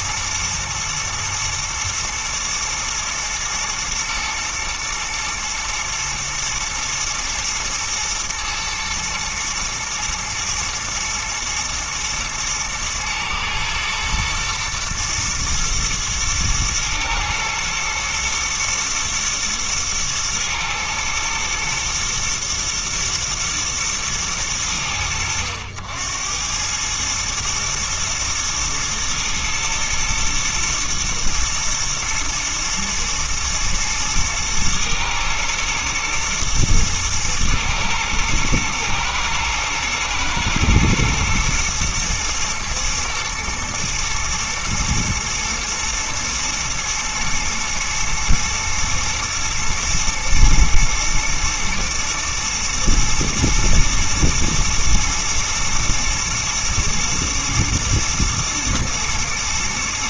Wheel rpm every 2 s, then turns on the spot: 110, 110, 110, 110, 120, 110, 110, 110, 110, 110, 110, 110, 90, 100, 110, 120, 110, 110, 120, 110, 110, 120, 120, 110, 110, 110, 120, 120, 110, 110.
none